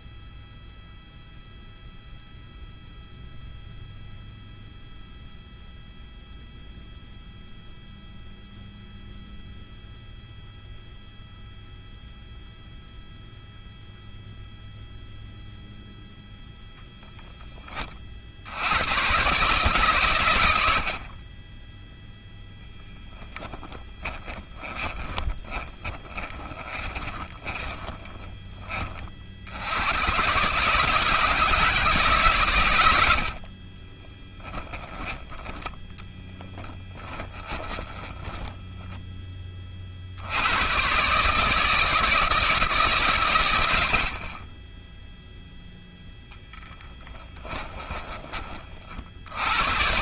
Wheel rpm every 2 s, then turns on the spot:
0, 0, 0, 0, 0, 0, 0, 0, 0, 120, 60, 0, 20, 30, 40, 160, 100, 20, 10, 10, 130, 130, 10, 10, 70.
24-28 36-38 46-48